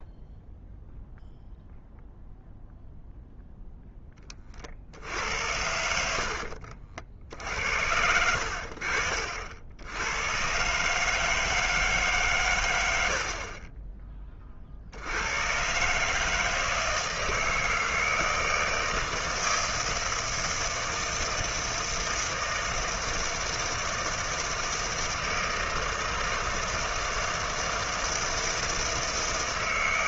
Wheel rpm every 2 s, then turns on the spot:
0, 0, 60, 60, 60, 130, 110, 50, 160, 160, 160, 160, 160, 160, 160.
none